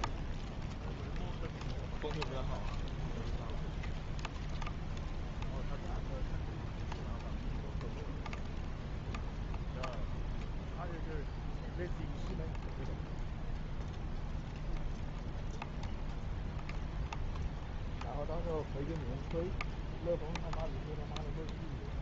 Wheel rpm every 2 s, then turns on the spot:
0, 0, 0, 0, 0, 0, 0, 0, 0, 0, 0.
none